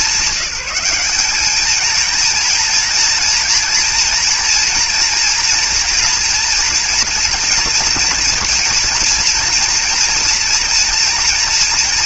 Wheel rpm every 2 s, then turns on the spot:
190, 230, 230, 240, 230, 230.
none